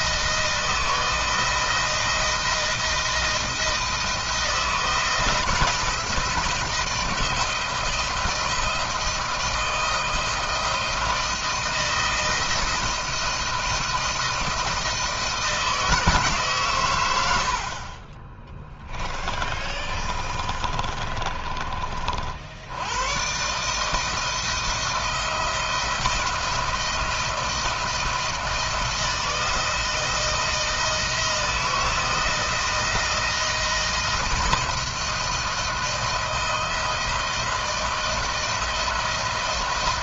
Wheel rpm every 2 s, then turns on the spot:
160, 170, 170, 170, 160, 170, 170, 160, 120, 20, 30, 100, 170, 170, 160, 160, 160, 160, 160, 170.
18-22